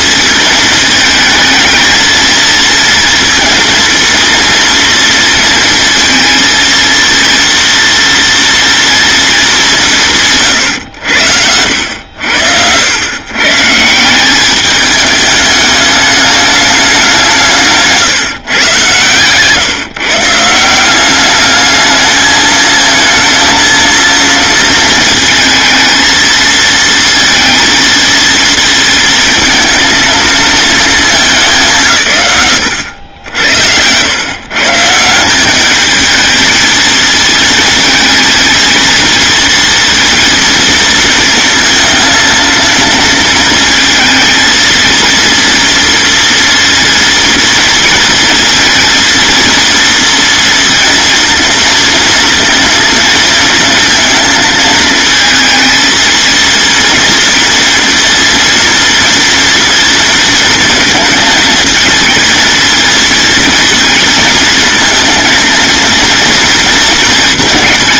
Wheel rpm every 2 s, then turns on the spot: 220, 220, 230, 230, 230, 100, 100, 210, 190, 130, 190, 220, 230, 230, 220, 220, 80, 160, 220, 220, 230, 230, 230, 230, 230, 230, 230, 220, 230, 230, 230, 230, 230, 230.
none